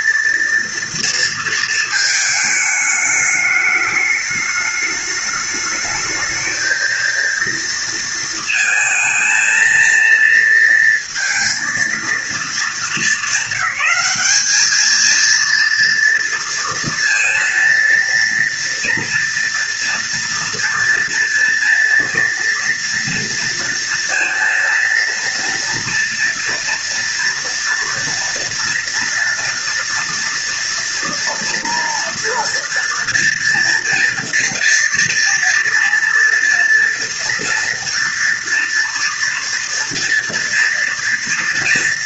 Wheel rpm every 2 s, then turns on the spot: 230, 210, 210, 220, 230, 230, 220, 220, 230, 230, 230, 230, 230, 230, 230, 230, 230, 230, 230, 230, 230.
none